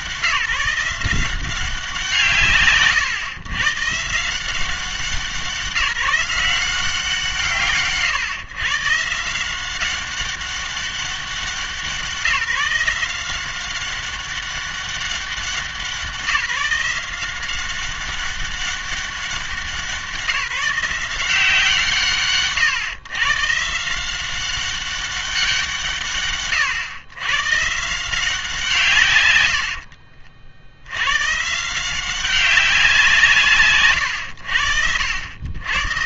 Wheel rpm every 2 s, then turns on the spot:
180, 140, 180, 180, 130, 200, 170, 200, 180, 200, 170, 140, 190, 120, 160, 70, 190, 80.
none